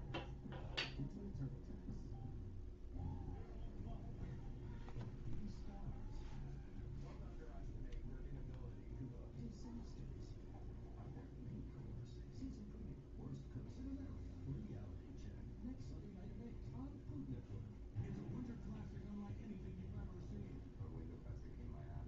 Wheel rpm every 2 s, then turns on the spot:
0, 0, 0, 0, 0, 0, 0, 0, 0, 0, 0.
none